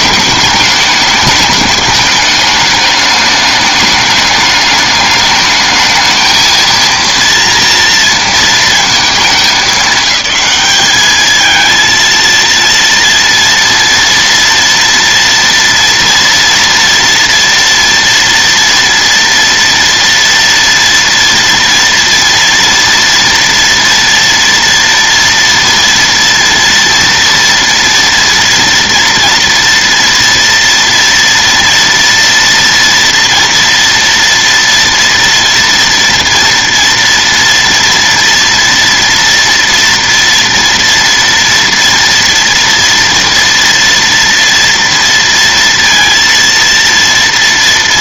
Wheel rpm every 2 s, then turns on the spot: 210, 210, 210, 220, 230, 210, 230, 230, 230, 230, 230, 230, 230, 230, 230, 230, 230, 230, 230, 240, 230, 230, 230, 230.
none